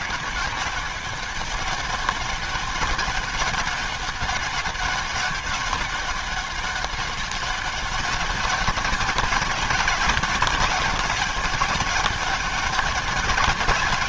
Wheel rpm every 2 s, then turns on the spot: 200, 200, 200, 200, 190, 200, 200.
none